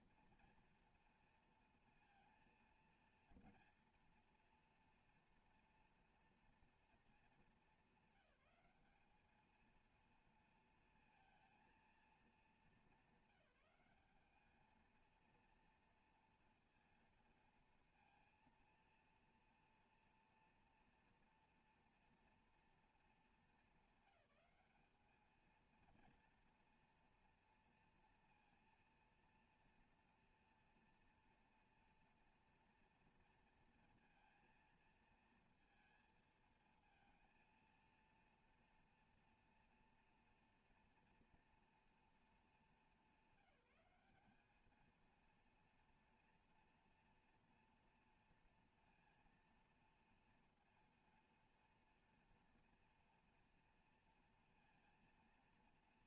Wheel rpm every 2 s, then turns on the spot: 230, 230, 230, 230, 210, 230, 210, 210, 230, 230, 230, 230, 200, 230, 230, 230, 240, 230, 230, 230, 240, 220, 210, 230, 230, 230, 230, 230.
none